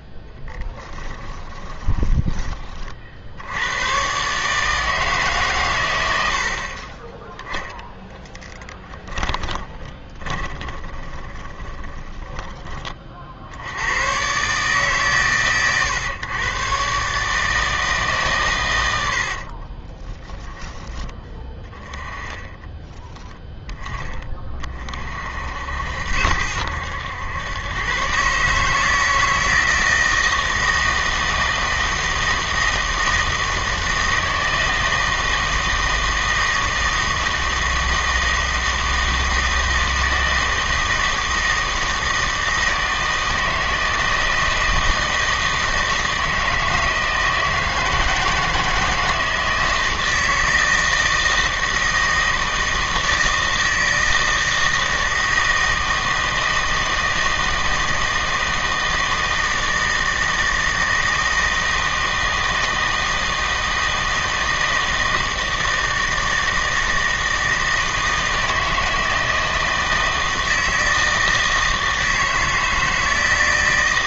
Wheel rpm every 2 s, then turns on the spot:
10, 40, 150, 50, 10, 20, 20, 140, 120, 100, 20, 10, 30, 80, 150, 160, 160, 160, 160, 160, 160, 160, 160, 160, 160, 160, 160, 160, 160, 160, 160, 160, 160, 160, 160, 160, 160.
0-2 8-12 20-24